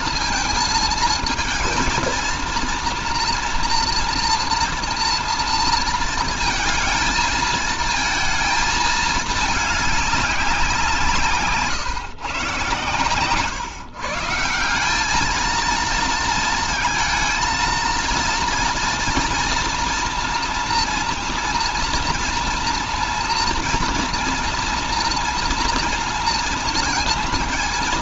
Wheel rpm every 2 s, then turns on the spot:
230, 230, 240, 230, 230, 200, 130, 170, 230, 230, 230, 230, 230, 230.
none